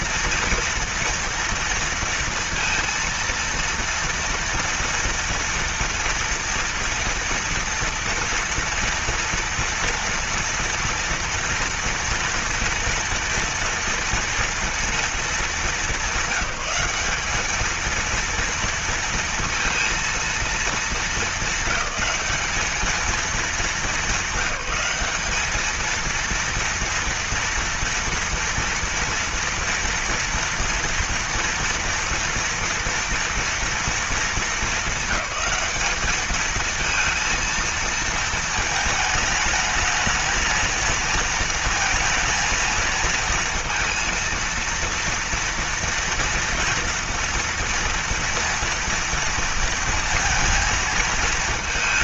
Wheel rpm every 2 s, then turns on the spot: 230, 230, 230, 230, 230, 230, 230, 230, 190, 230, 220, 200, 200, 230, 230, 230, 230, 220, 220, 220, 220, 230, 230, 240, 230, 230.
none